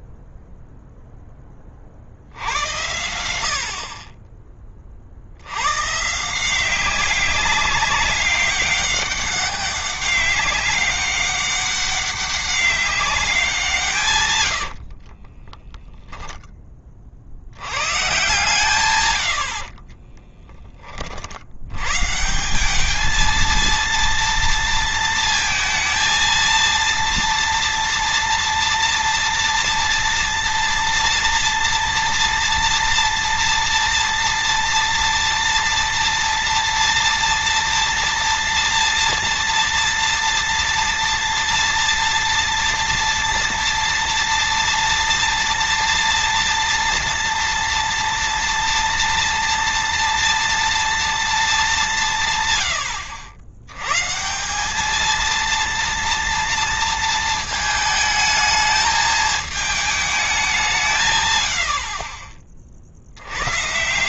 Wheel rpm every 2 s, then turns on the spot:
0, 80, 30, 180, 200, 200, 200, 90, 10, 140, 30, 200, 230, 230, 230, 230, 240, 230, 230, 230, 230, 230, 230, 240, 230, 230, 130, 190, 230, 220, 200, 40.
14-16